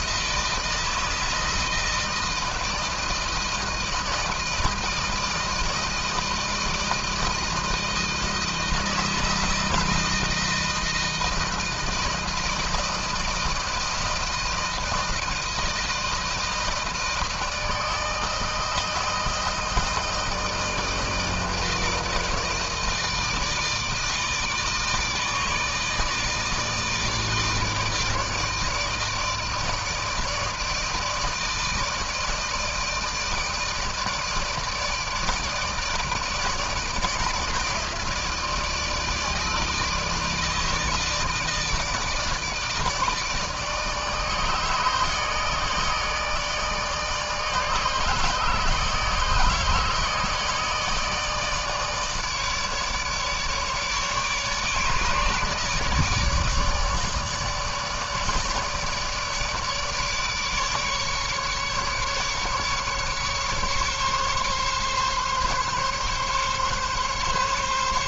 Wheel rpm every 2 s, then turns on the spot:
160, 160, 160, 160, 160, 160, 160, 160, 160, 160, 160, 160, 160, 160, 150, 160, 160, 160, 160, 160, 160, 160, 160, 160, 150, 150, 150, 150, 150, 150, 150, 140, 140, 140.
none